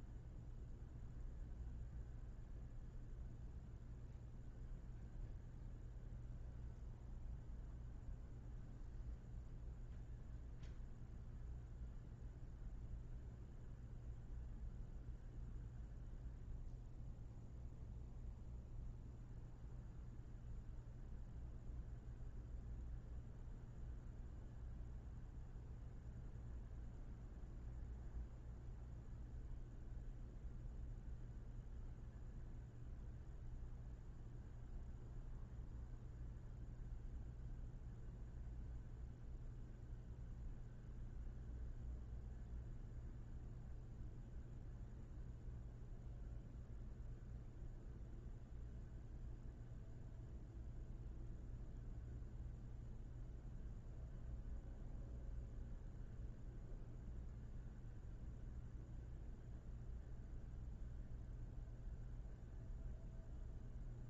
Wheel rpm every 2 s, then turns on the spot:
0, 0, 0, 0, 0, 0, 0, 0, 0, 0, 0, 0, 0, 0, 0, 0, 0, 0, 0, 0, 0, 0, 0, 0, 0, 0, 0, 0, 0, 0, 0, 0.
none